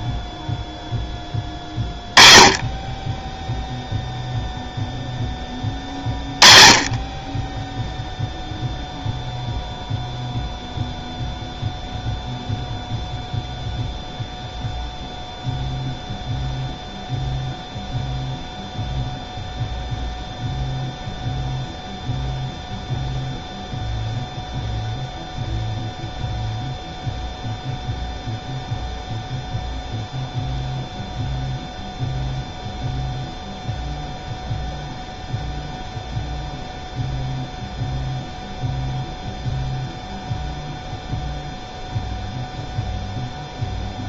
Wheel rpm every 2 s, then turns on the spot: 0, 20, 0, 10, 0, 0, 0, 0, 0, 0, 0, 0, 0, 0, 0, 0, 0, 0, 0, 0, 0, 0.
none